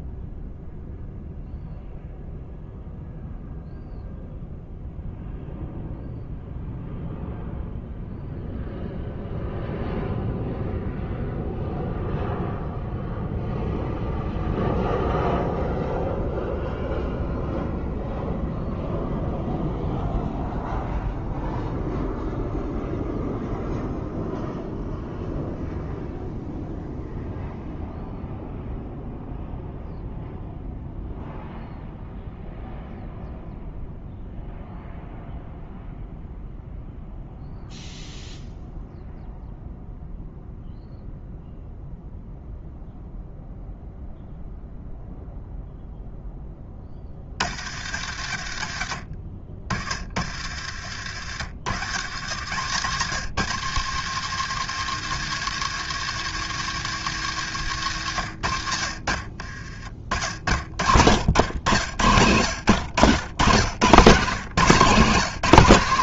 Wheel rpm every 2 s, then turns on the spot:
0, 0, 0, 0, 0, 0, 0, 0, 0, 0, 0, 0, 0, 0, 0, 0, 0, 0, 0, 0, 0, 0, 0, 10, 80, 60, 100, 140, 150, 80, 60, 110, 160.
none